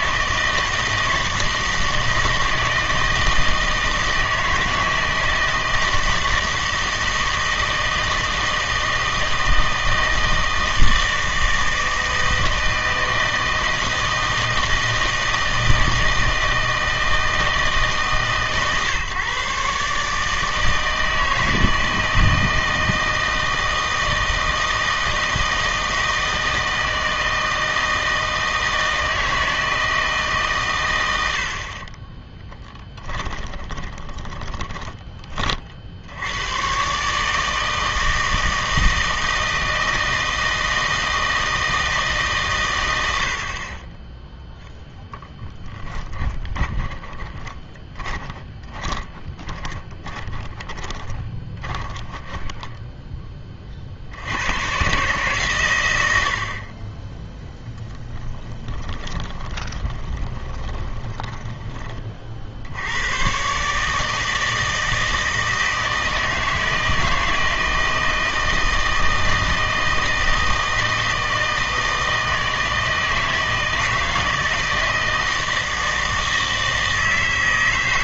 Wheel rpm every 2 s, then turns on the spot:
160, 160, 160, 160, 160, 160, 160, 160, 160, 140, 160, 160, 160, 160, 160, 130, 10, 10, 110, 160, 160, 130, 0, 20, 20, 20, 10, 110, 40, 10, 20, 60, 160, 160, 160, 160, 160, 160, 160.
32-36 46-54 58-62